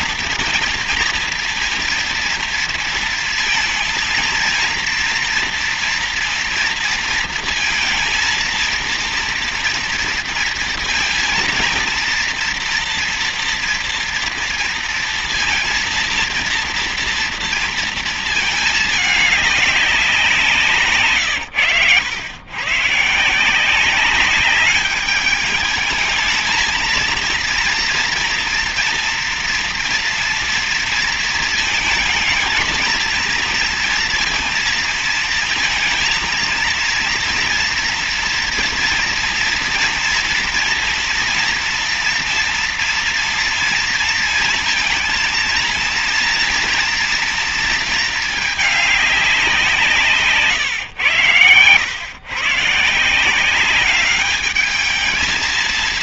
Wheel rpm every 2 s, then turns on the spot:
230, 230, 230, 230, 230, 230, 230, 230, 230, 220, 170, 120, 200, 220, 230, 230, 230, 230, 230, 230, 240, 230, 230, 230, 210, 130, 130, 210.
none